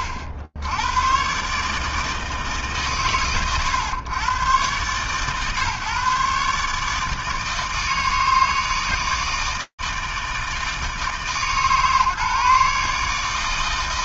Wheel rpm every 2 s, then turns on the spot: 90, 150, 110, 140, 160, 160, 150.
none